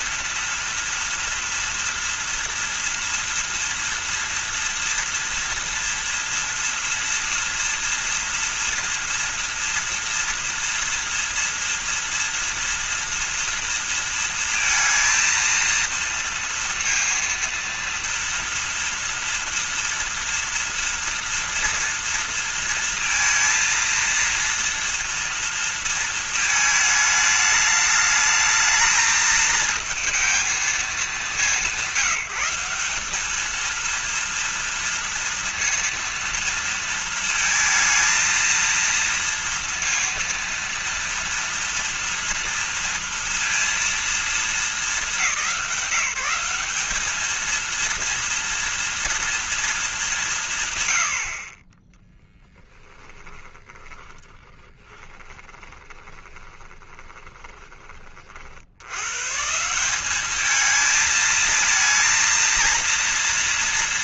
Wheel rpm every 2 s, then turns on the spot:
230, 230, 240, 230, 240, 230, 230, 230, 230, 230, 230, 230, 230, 220, 220, 210, 190, 230, 230, 230, 230, 230, 220, 190, 230, 160, 10, 20, 20, 60, 210, 230.
52-58